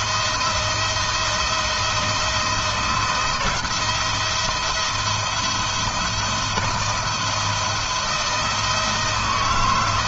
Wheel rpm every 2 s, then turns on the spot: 170, 160, 170, 170, 160.
none